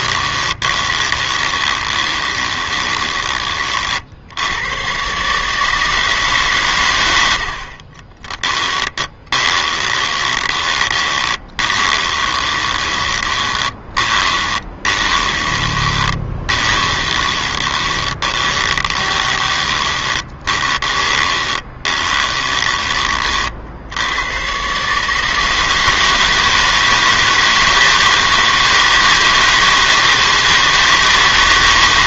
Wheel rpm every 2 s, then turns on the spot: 20, 20, 90, 140, 20, 20, 20, 20, 20, 20, 20, 20, 120, 160, 160, 160.
0-4 8-24